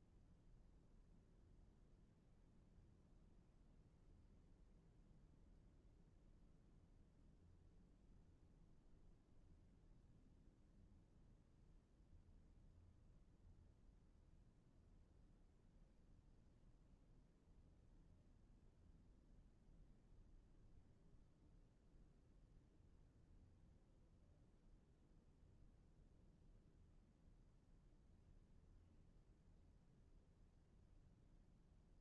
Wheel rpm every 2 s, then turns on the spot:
0, 0, 0, 0, 0, 0, 0, 0, 0, 0, 0, 0, 0, 0, 0, 0.
none